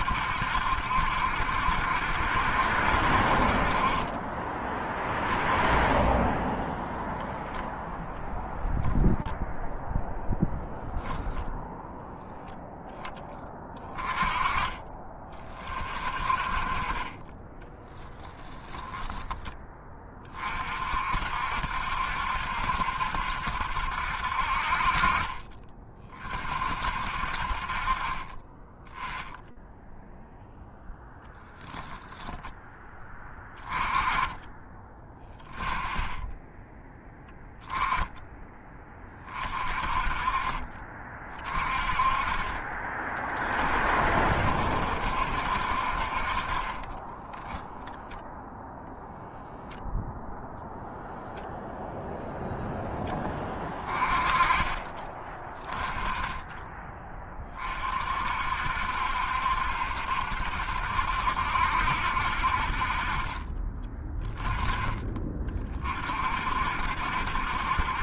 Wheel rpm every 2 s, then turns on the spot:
70, 70, 30, 10, 0, 0, 0, 20, 30, 10, 30, 70, 60, 40, 30, 0, 10, 20, 10, 10, 30, 30, 60, 40, 0, 0, 0, 20, 10, 50, 70, 60, 20, 60.
18-20